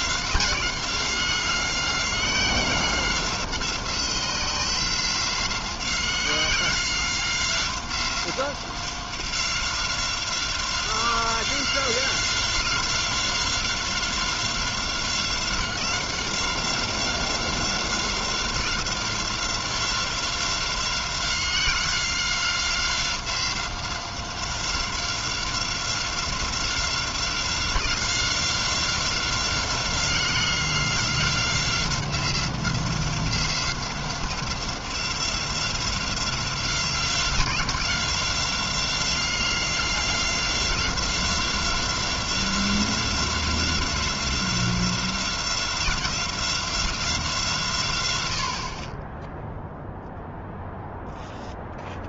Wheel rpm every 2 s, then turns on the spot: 180, 180, 180, 180, 190, 180, 180, 180, 180, 180, 180, 180, 180, 180, 180, 180, 180, 180, 180, 180, 180, 180, 180, 160, 10, 0.
none